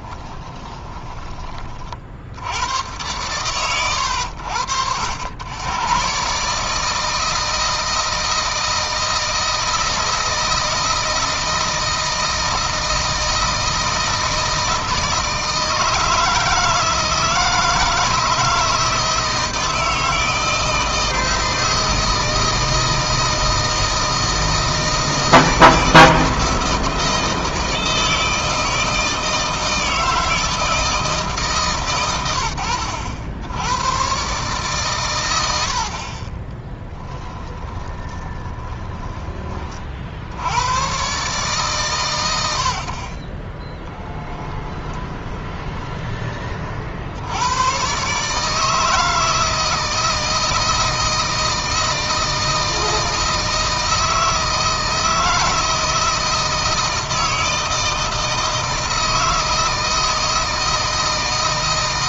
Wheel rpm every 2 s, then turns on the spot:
10, 100, 80, 150, 160, 160, 160, 160, 160, 160, 160, 160, 160, 160, 160, 160, 80, 130, 20, 20, 100, 60, 10, 50, 160, 160, 160, 160, 160, 160, 160.
0-2 36-40 44-46